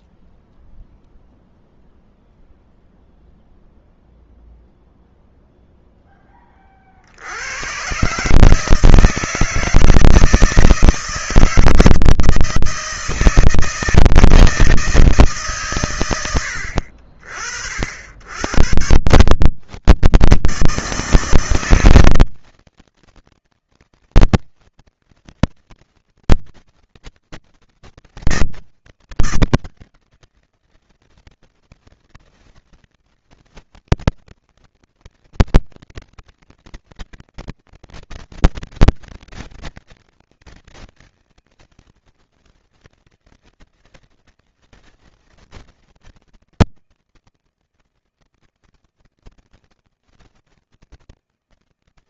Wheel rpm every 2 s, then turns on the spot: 0, 0, 0, 30, 150, 160, 160, 160, 70, 70, 140, 160, 160, 160, 160, 160, 160, 160, 160, 160, 160, 160, 160, 160, 160, 160.
none